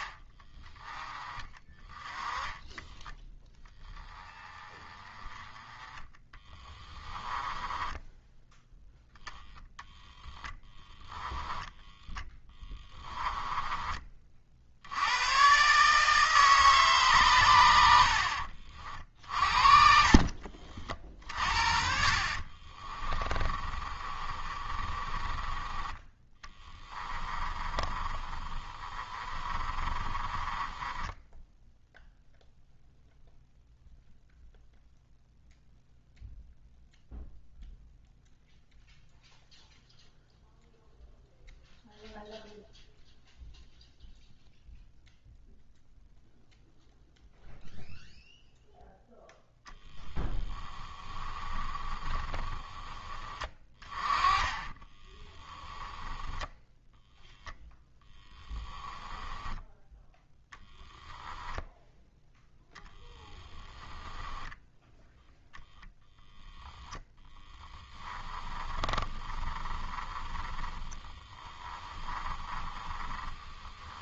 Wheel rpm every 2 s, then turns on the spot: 20, 10, 20, 10, 0, 10, 10, 70, 140, 50, 50, 40, 30, 20, 30, 20, 0, 0, 0, 0, 0, 0, 0, 0, 0, 10, 20, 30, 0, 10, 0, 0, 10, 10, 20, 20, 20.
6-8 12-14 18-20 22-32 50-52 54-56 66-74